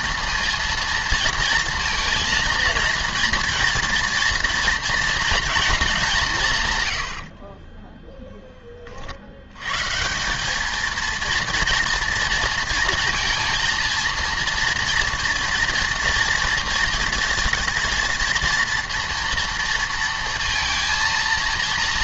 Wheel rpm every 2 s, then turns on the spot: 230, 230, 230, 140, 20, 210, 230, 230, 230, 230, 230.
none